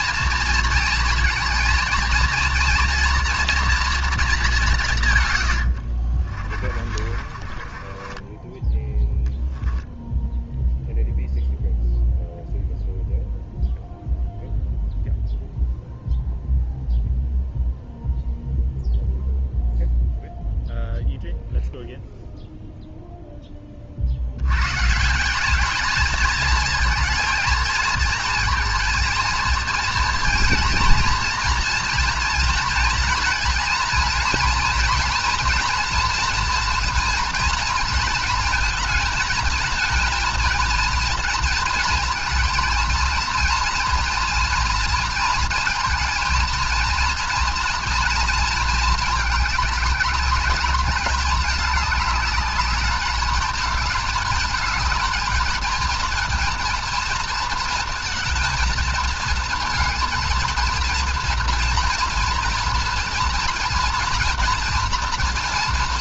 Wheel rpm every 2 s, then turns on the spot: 230, 230, 190, 40, 20, 0, 0, 0, 0, 0, 0, 0, 110, 220, 230, 230, 230, 230, 230, 230, 230, 230, 230, 230, 230, 210, 210, 220, 230, 220, 230, 230, 240.
6-10